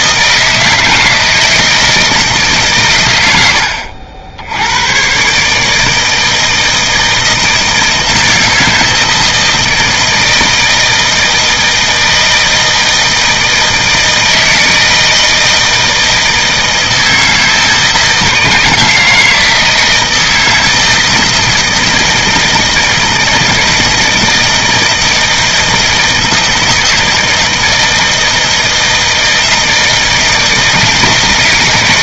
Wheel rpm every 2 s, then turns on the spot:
160, 130, 90, 160, 160, 160, 160, 160, 160, 160, 160, 160, 160, 160, 160, 160.
none